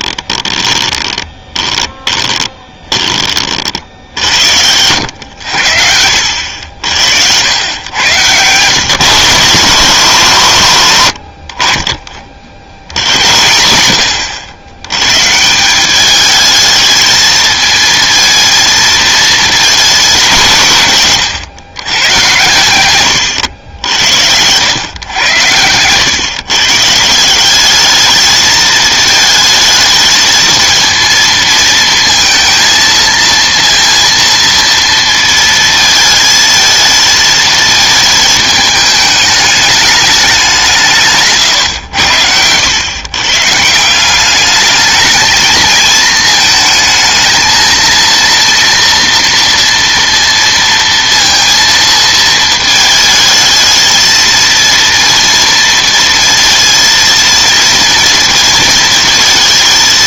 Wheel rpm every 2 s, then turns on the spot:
20, 20, 90, 80, 140, 120, 70, 100, 220, 220, 170, 110, 100, 150, 220, 230, 230, 230, 220, 210, 180, 110, 210, 220, 230, 230, 220, 230, 230, 220.
0-4